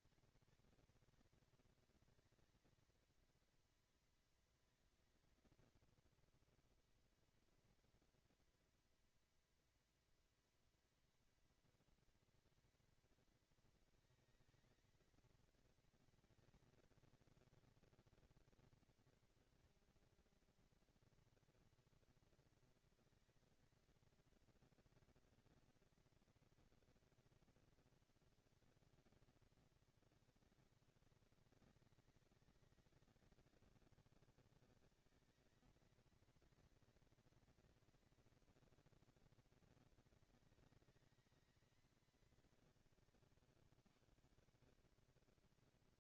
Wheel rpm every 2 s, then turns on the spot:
230, 230, 230, 230, 230, 230, 230, 220, 230, 230, 230, 230, 230, 230, 230, 210, 190, 200, 230, 230, 220, 210, 180.
none